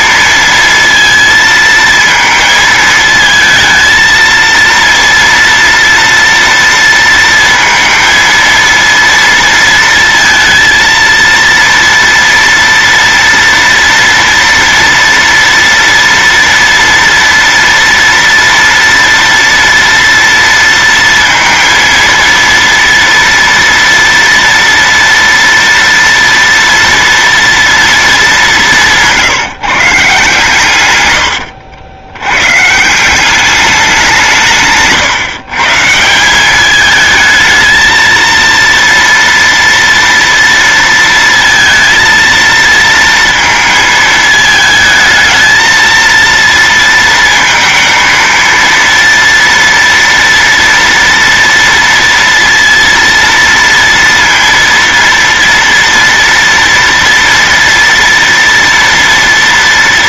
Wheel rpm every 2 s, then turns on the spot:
230, 220, 230, 230, 230, 230, 230, 230, 230, 230, 230, 230, 230, 230, 190, 130, 130, 160, 200, 230, 230, 230, 220, 230, 230, 230, 230, 230, 230, 240.
none